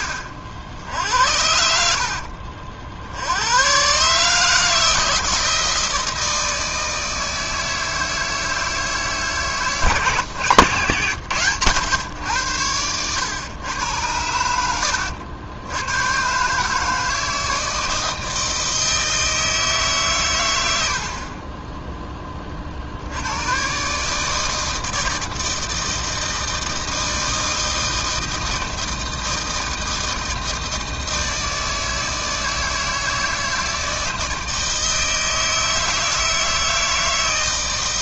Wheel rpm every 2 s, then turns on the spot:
60, 70, 160, 160, 150, 120, 100, 70, 150, 160, 70, 80, 160, 160, 160, 160, 160, 160, 160.
none